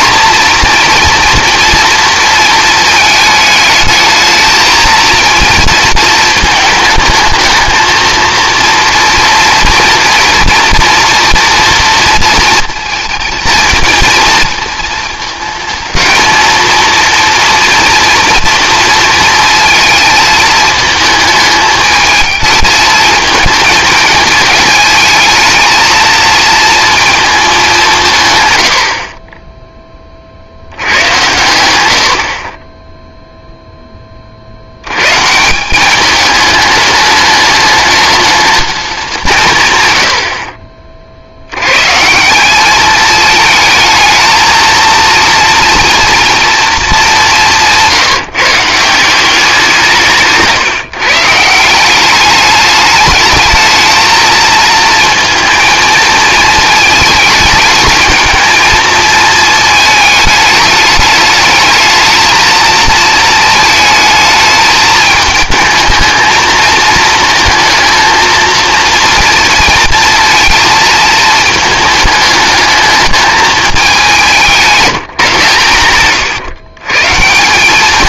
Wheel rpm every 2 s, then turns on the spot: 230, 220, 220, 220, 230, 230, 230, 230, 230, 230, 220, 220, 220, 230, 100, 80, 30, 80, 210, 210, 50, 200, 230, 230, 160, 150, 210, 230, 220, 220, 210, 220, 220, 220, 230, 230, 210, 180, 140.
none